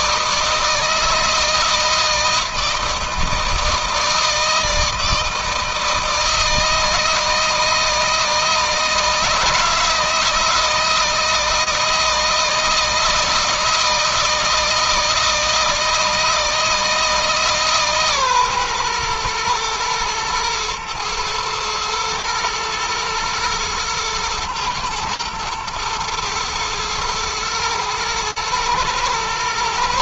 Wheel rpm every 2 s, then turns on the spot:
160, 160, 160, 160, 160, 160, 160, 160, 160, 130, 120, 120, 110, 120, 110.
none